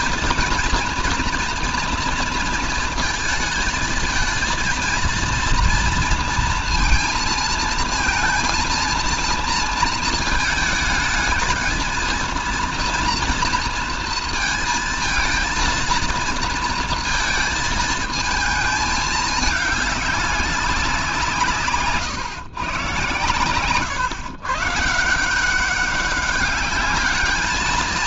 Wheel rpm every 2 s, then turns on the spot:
230, 230, 230, 230, 230, 220, 230, 230, 230, 220, 190, 130, 140, 200.
none